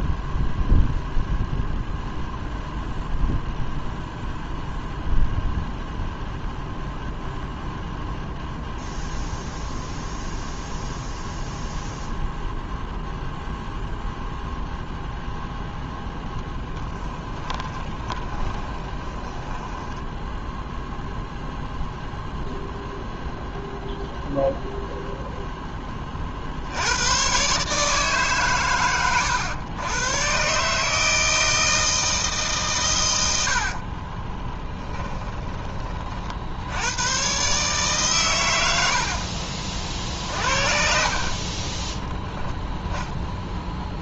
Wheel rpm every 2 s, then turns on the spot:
0, 0, 0, 0, 0, 0, 0, 0, 10, 20, 0, 0, 0, 90, 110, 150, 120, 10, 90, 70, 50, 10.
16-20 34-36 38-42